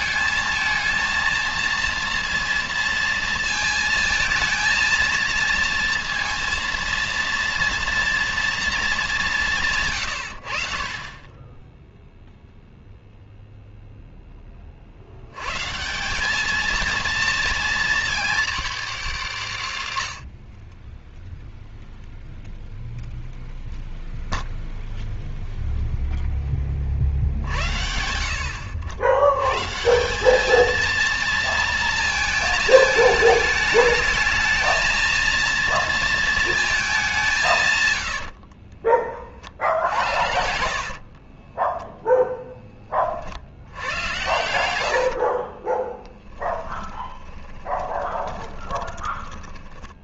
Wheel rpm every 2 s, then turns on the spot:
220, 230, 220, 230, 230, 70, 0, 20, 220, 230, 50, 0, 0, 20, 70, 210, 220, 220, 230, 40, 60, 10, 90, 10, 20.
38-42 44-50